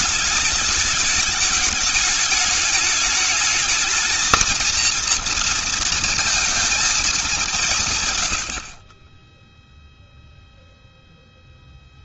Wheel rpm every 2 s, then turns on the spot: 220, 210, 230, 220, 60, 0.
8-10